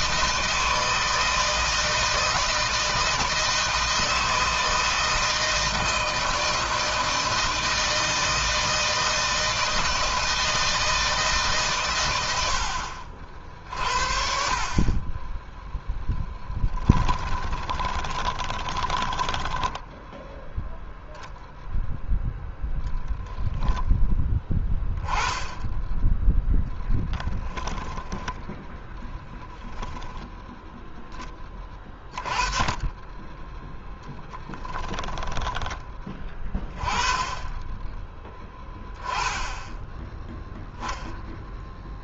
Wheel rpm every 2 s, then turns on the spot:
160, 160, 160, 160, 160, 160, 80, 40, 10, 10, 0, 0, 10, 10, 10, 10, 20, 10, 30, 10, 0.
18-20 26-30 34-36